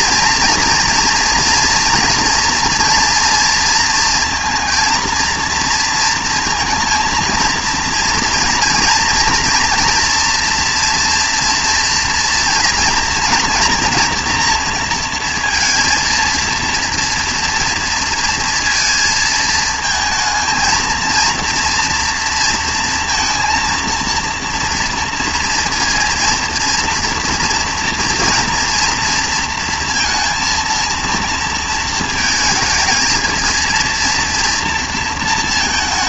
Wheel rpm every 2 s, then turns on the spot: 230, 240, 230, 230, 230, 230, 230, 230, 230, 230, 220, 230, 230, 230, 230, 230, 230, 230.
none